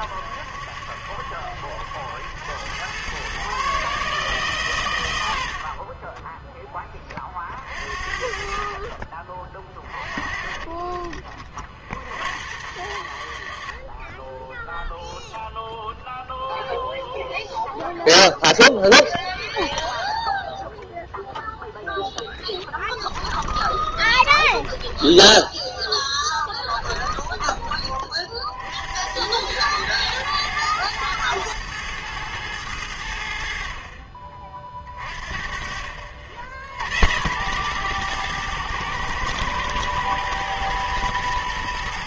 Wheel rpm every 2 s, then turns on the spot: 70, 110, 130, 20, 40, 40, 90, 0, 0, 0, 0, 10, 20, 20, 60, 110, 90, 40, 80, 110, 120.
22-28